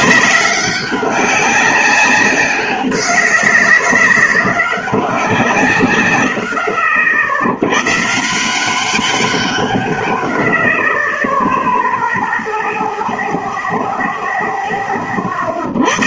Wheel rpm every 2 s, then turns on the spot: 190, 190, 200, 80, 180, 50, 0, 10.
none